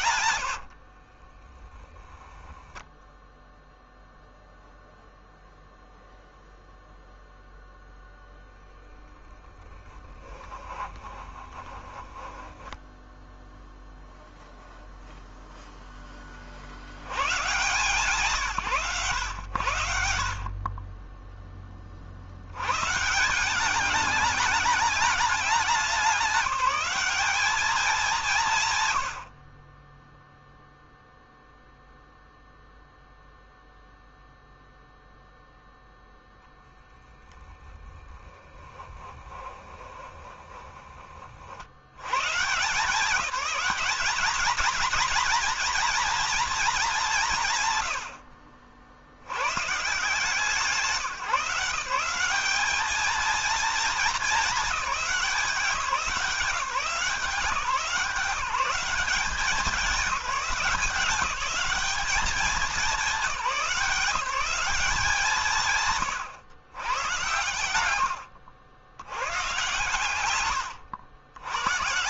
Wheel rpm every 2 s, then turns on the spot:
70, 0, 0, 0, 10, 20, 10, 0, 80, 120, 30, 130, 210, 200, 130, 0, 0, 0, 0, 10, 30, 170, 230, 200, 70, 160, 220, 190, 180, 190, 190, 200, 180, 110, 100, 100.
0-2 10-14 38-40